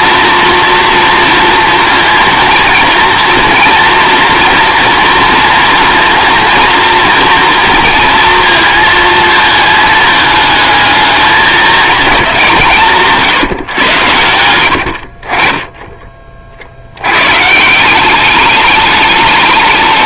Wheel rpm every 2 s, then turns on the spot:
230, 230, 230, 230, 230, 220, 170, 80, 80, 210.
14-16